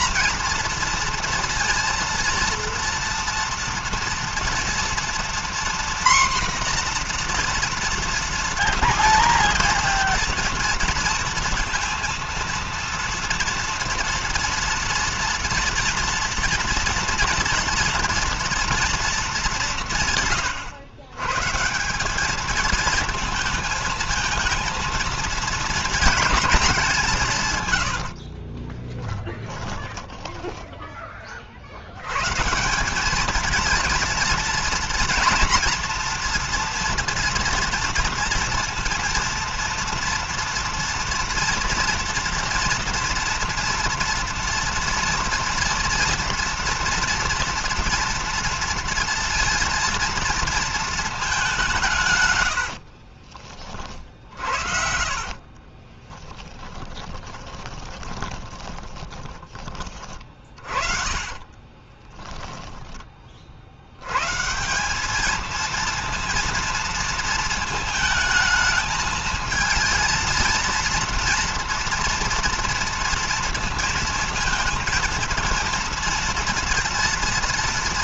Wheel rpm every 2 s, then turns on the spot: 230, 230, 230, 250, 230, 230, 230, 230, 230, 230, 140, 210, 230, 220, 40, 20, 150, 230, 230, 230, 230, 230, 230, 230, 230, 230, 100, 40, 20, 20, 40, 10, 150, 230, 220, 230, 230, 230, 230.
28-32 52-64